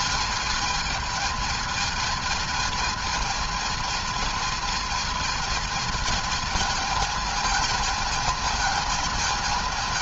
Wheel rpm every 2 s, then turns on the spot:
220, 220, 220, 210, 220.
none